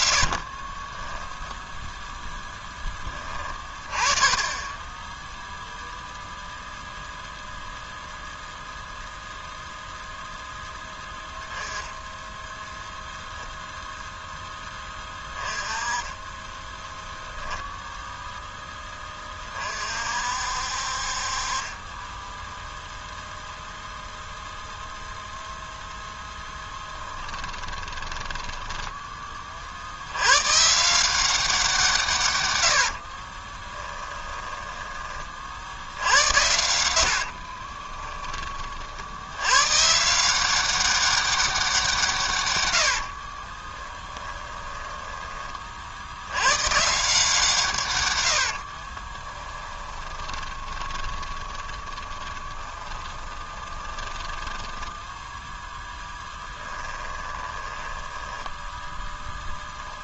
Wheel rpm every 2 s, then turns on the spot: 20, 10, 10, 0, 0, 0, 0, 20, 10, 10, 50, 0, 0, 10, 10, 140, 90, 20, 80, 40, 190, 100, 20, 130, 40, 20, 20, 10, 10, 10.
0-2 26-30 32-34 36-38 44-46 48-58